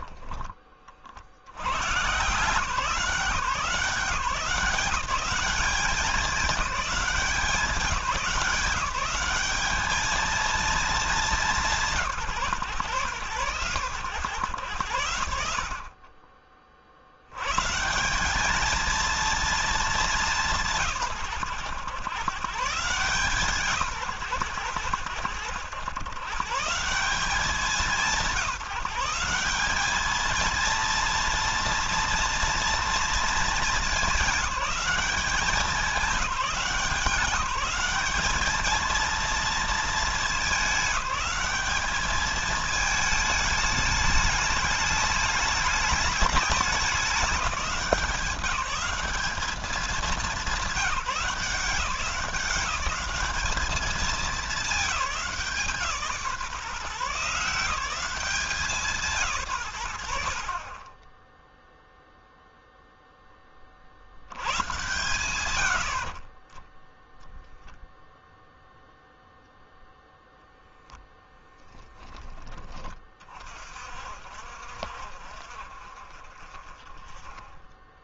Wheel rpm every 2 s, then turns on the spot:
40, 170, 190, 200, 190, 210, 100, 90, 60, 220, 120, 140, 80, 170, 170, 230, 230, 200, 190, 220, 210, 210, 210, 200, 200, 190, 180, 180, 140, 160, 20, 0, 90, 0, 0, 10, 30, 50, 20.
60-62